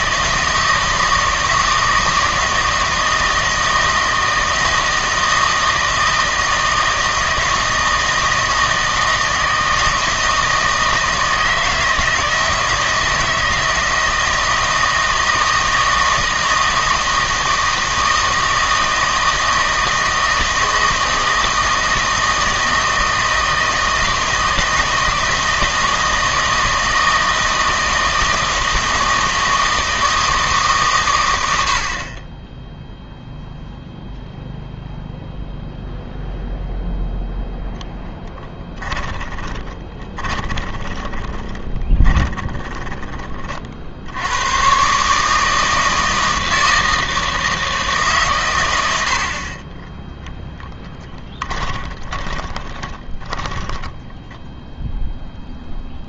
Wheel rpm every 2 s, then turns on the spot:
160, 160, 160, 160, 160, 160, 160, 160, 160, 160, 160, 160, 160, 160, 160, 150, 0, 0, 0, 10, 20, 30, 120, 160, 100, 10, 20, 0.
38-44 50-54